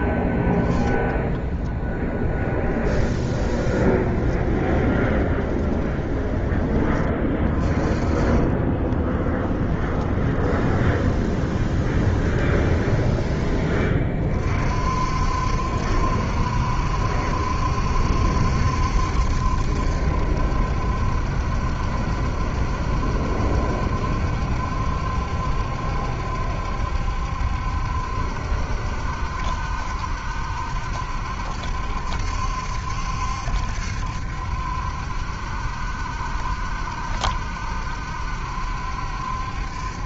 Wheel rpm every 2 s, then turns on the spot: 10, 10, 20, 20, 20, 20, 20, 50, 70, 70, 70, 70, 70, 70, 70, 70, 70, 70, 70, 70.
4-6 8-14